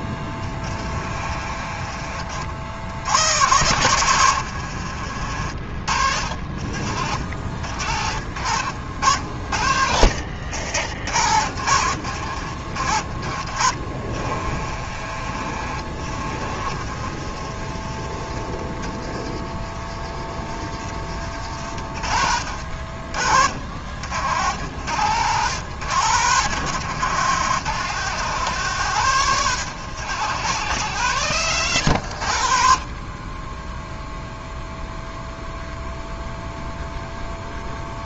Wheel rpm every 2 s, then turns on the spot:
30, 80, 80, 70, 70, 80, 60, 60, 50, 40, 40, 60, 90, 110, 130, 110, 60, 0, 0.
0-2 4-6 14-18